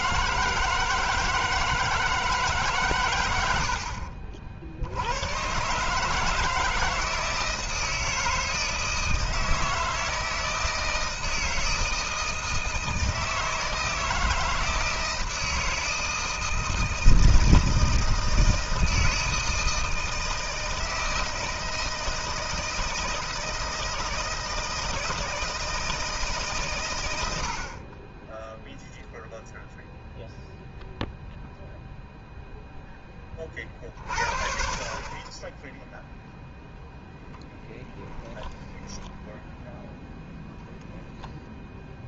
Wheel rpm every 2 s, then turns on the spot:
160, 140, 70, 160, 160, 160, 160, 160, 160, 160, 160, 160, 160, 110, 0, 0, 0, 40, 0, 10, 0.
none